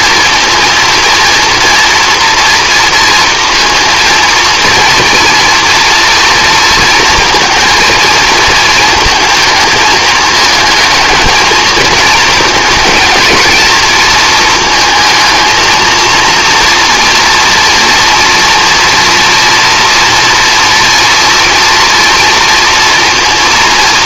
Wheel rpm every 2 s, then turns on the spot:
230, 230, 230, 230, 230, 220, 230, 230, 230, 240, 230, 230.
none